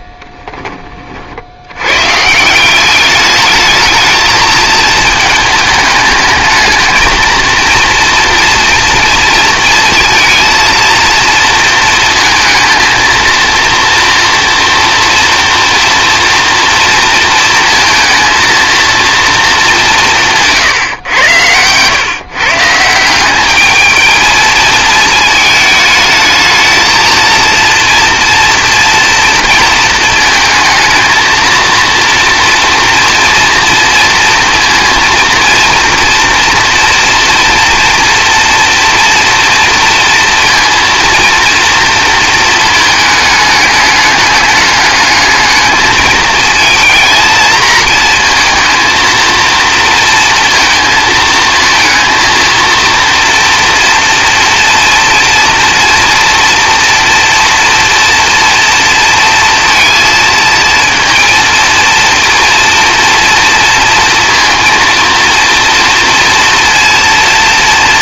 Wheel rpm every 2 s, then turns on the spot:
20, 180, 220, 220, 230, 230, 230, 230, 230, 230, 150, 140, 220, 220, 230, 230, 230, 230, 230, 230, 230, 220, 200, 220, 230, 230, 230, 230, 240, 230, 230, 230, 230, 230.
20-22